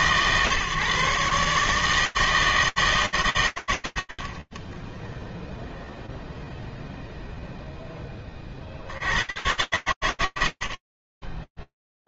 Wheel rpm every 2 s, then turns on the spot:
140, 160, 20, 0, 80, 100.
none